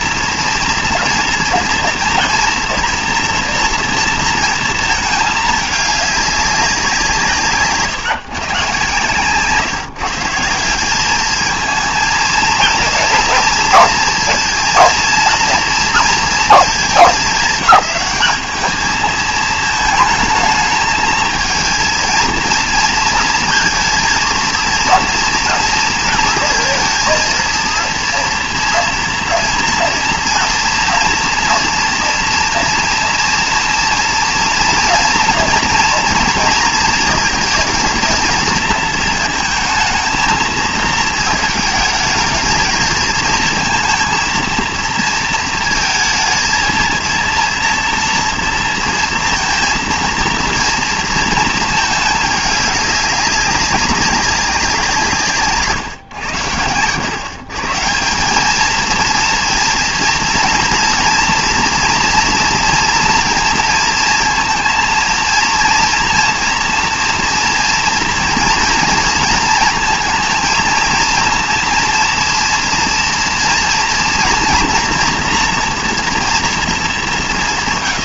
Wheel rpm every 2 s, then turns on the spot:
230, 230, 230, 200, 140, 170, 230, 230, 210, 210, 220, 230, 230, 230, 230, 230, 230, 230, 230, 220, 220, 220, 230, 230, 230, 230, 210, 180, 110, 220, 230, 240, 230, 230, 230, 230, 230, 230, 230.
none